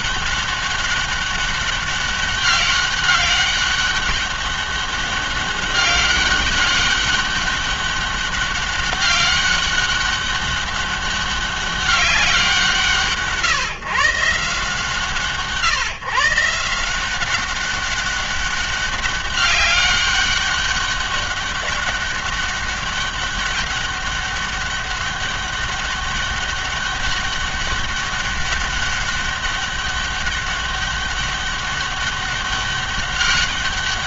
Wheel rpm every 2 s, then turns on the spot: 200, 190, 200, 200, 190, 190, 170, 150, 160, 200, 200, 200, 200, 200, 200, 200, 200.
none